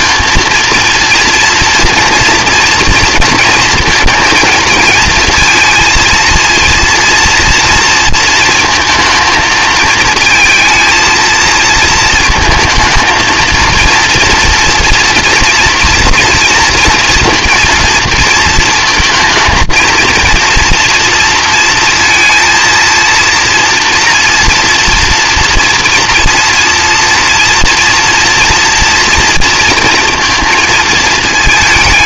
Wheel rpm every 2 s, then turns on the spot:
230, 230, 230, 230, 230, 230, 230, 240, 230, 220, 230, 230, 240, 230, 230, 220.
none